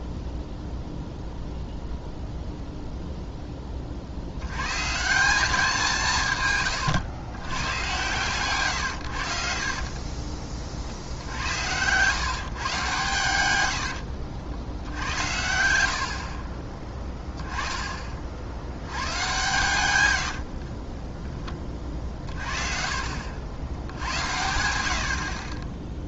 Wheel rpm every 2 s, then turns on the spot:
0, 0, 100, 120, 120, 40, 140, 80, 30, 70, 60, 40, 80.
20-22